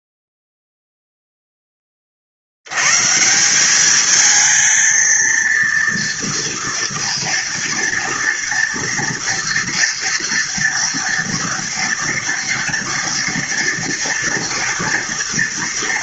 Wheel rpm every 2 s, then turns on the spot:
0, 130, 230, 230, 240, 230, 230, 230.
none